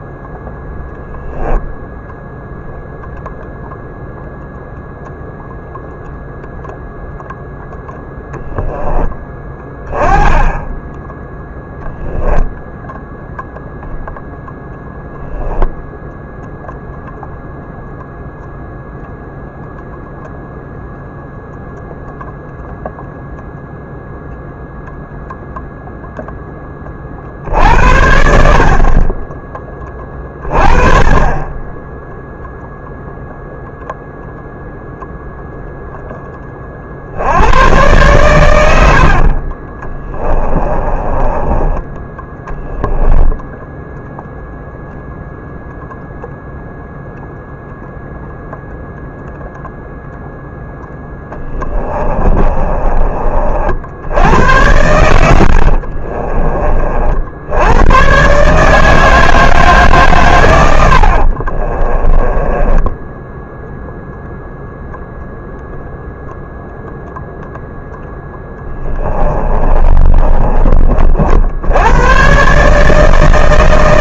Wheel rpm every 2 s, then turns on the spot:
0, 0, 0, 0, 10, 10, 0, 0, 0, 0, 0, 0, 0, 20, 40, 30, 0, 0, 40, 80, 20, 10, 0, 0, 0, 0, 30, 90, 40, 150, 100, 10, 0, 0, 10, 30, 150.
40-44 52-54 60-64 68-70